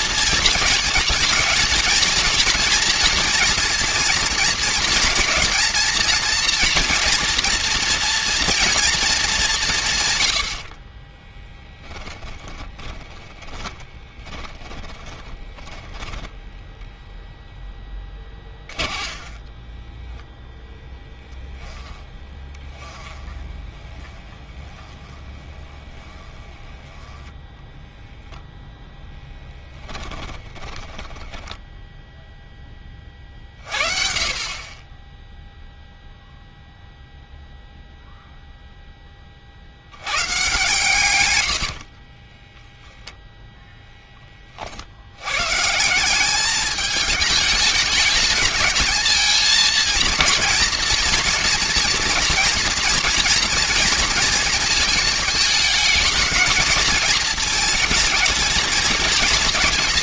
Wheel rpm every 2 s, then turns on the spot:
220, 230, 230, 230, 230, 60, 20, 10, 10, 30, 10, 30, 20, 20, 0, 20, 20, 30, 0, 0, 120, 0, 40, 210, 220, 230, 230, 220, 220, 220.
10-28 30-32